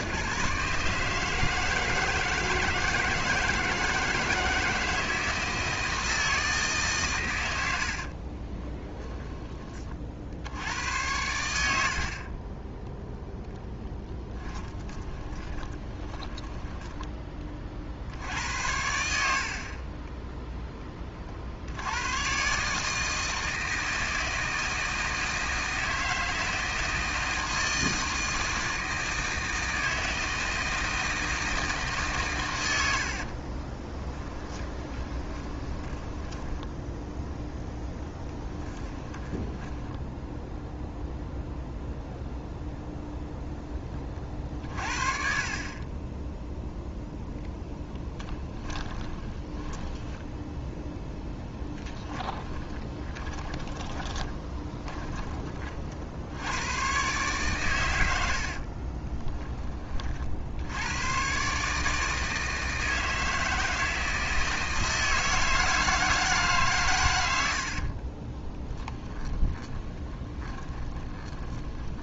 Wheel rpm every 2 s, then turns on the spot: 150, 160, 160, 140, 10, 90, 0, 20, 10, 80, 20, 150, 160, 160, 160, 160, 90, 20, 0, 10, 0, 0, 40, 0, 10, 0, 20, 20, 110, 30, 100, 160, 160, 130, 10, 20.
8-10 14-18 32-36 38-40 48-50 52-56 58-60 68-72